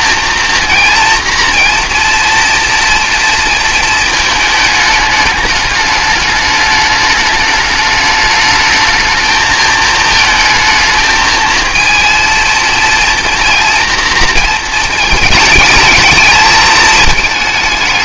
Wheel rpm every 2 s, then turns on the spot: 230, 230, 210, 210, 220, 220, 230, 220, 220.
none